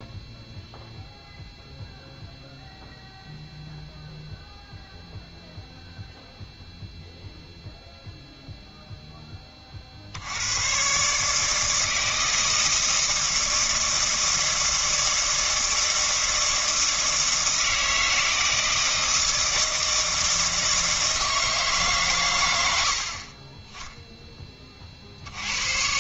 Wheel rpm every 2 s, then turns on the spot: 0, 0, 0, 0, 0, 120, 160, 160, 160, 160, 160, 60, 40.
none